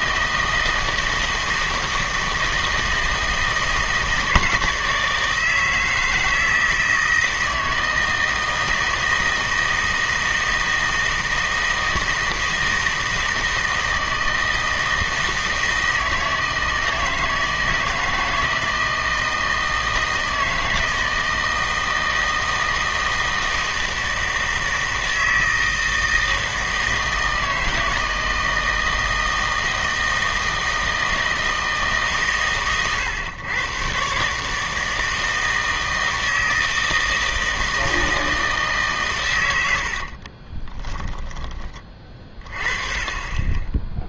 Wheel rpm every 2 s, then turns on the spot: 160, 160, 160, 160, 160, 160, 160, 160, 160, 160, 160, 160, 160, 160, 160, 160, 130, 160, 160, 150, 20, 20.
40-42